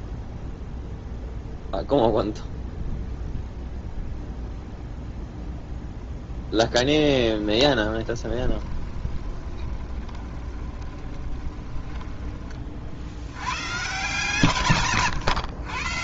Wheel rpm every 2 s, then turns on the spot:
0, 0, 0, 10, 20, 20, 50, 130.
6-12 14-16